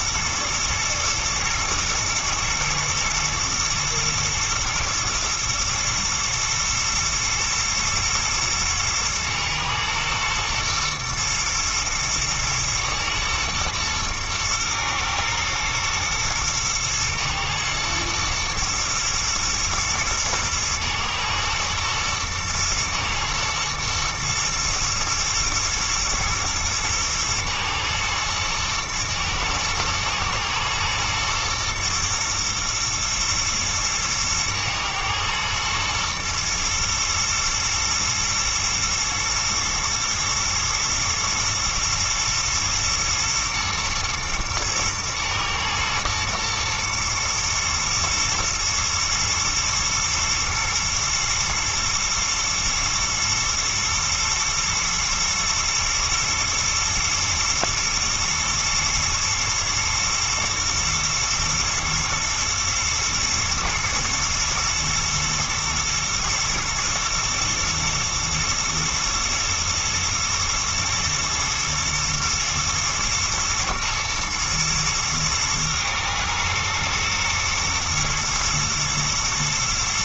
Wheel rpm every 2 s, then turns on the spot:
120, 110, 110, 110, 110, 120, 110, 110, 110, 110, 110, 110, 110, 110, 110, 120, 110, 110, 110, 120, 120, 120, 110, 120, 110, 120, 120, 120, 110, 110, 120, 110, 110, 120, 120, 110, 110, 110, 110, 120.
none